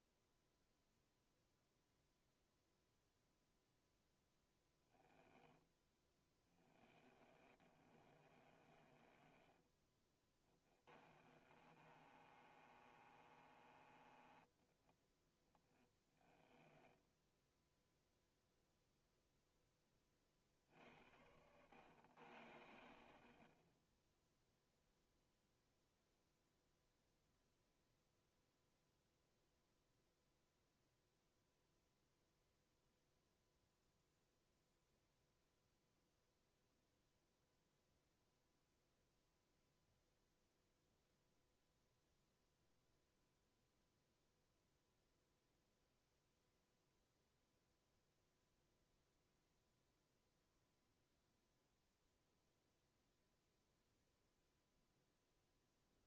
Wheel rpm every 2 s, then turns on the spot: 0, 0, 10, 30, 20, 30, 30, 10, 10, 0, 70, 60, 0, 0, 0, 0, 0, 0, 0, 0, 0, 0, 0, 0, 0, 0, 0, 0.
4-14 16-18